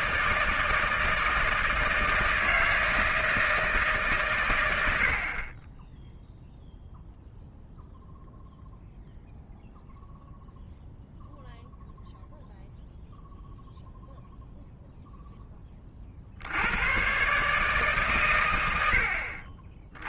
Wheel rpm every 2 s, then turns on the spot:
160, 160, 100, 0, 0, 0, 0, 0, 90, 100.
none